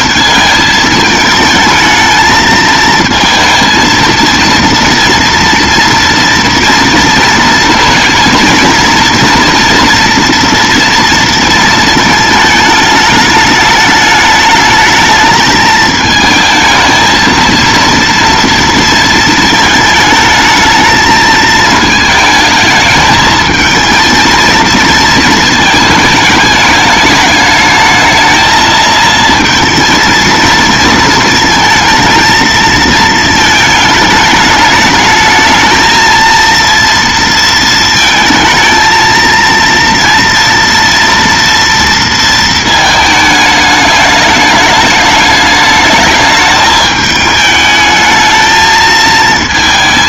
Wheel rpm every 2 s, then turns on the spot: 220, 220, 230, 230, 230, 230, 210, 220, 220, 230, 220, 220, 220, 210, 220, 230, 230, 210, 230, 220, 230, 220, 210, 210, 220.
none